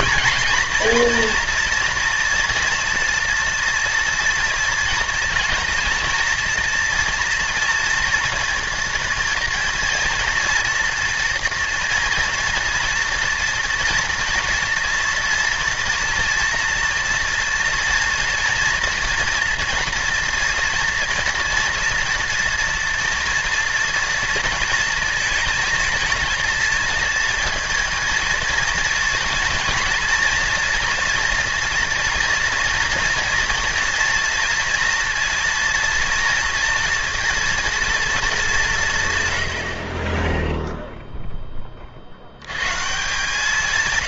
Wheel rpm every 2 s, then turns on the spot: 230, 240, 230, 230, 230, 240, 240, 230, 230, 230, 230, 230, 230, 220, 230, 230, 230, 230, 230, 180, 0, 120.
none